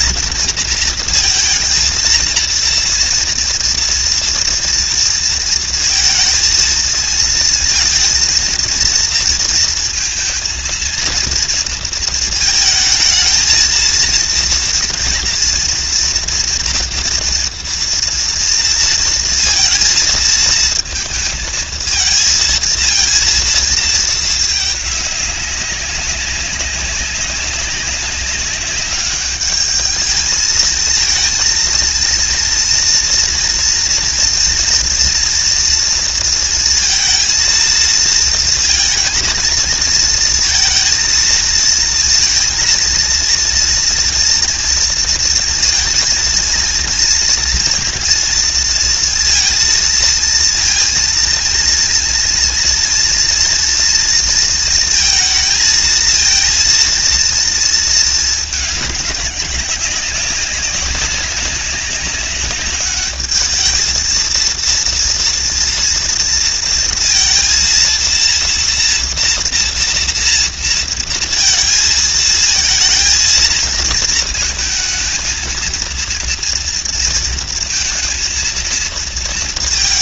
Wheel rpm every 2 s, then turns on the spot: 230, 240, 230, 220, 230, 230, 220, 230, 240, 230, 220, 230, 200, 200, 200, 230, 240, 230, 230, 230, 230, 230, 230, 230, 230, 230, 230, 230, 230, 210, 200, 210, 230, 230, 230, 230, 230, 220, 230, 230.
none